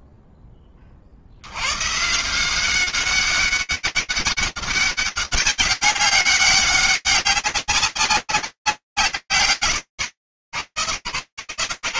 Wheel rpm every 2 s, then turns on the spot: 0, 120, 200, 200, 120, 110.
none